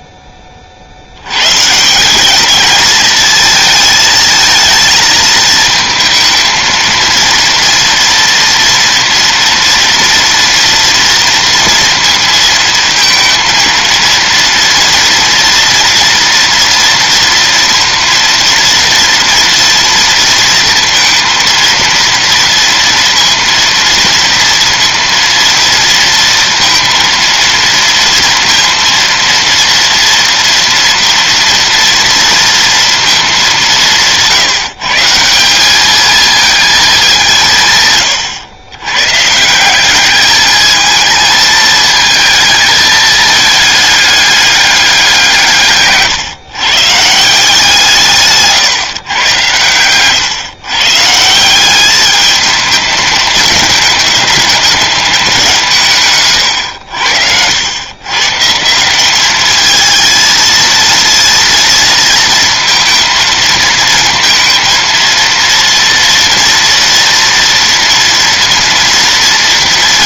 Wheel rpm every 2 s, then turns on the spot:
70, 220, 220, 230, 230, 230, 230, 230, 230, 230, 230, 230, 230, 230, 230, 230, 230, 160, 200, 120, 220, 220, 190, 160, 130, 160, 210, 200, 80, 190, 230, 220, 230, 230, 230.
none